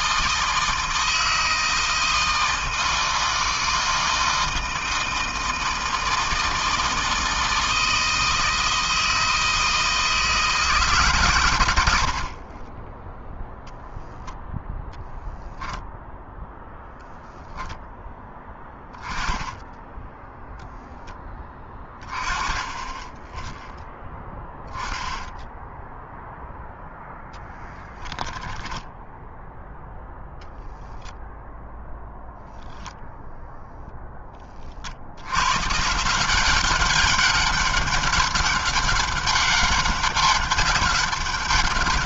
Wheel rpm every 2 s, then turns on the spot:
160, 160, 160, 160, 160, 160, 70, 0, 0, 10, 0, 20, 0, 0, 10, 0, 0, 10, 160, 200, 200.
28-30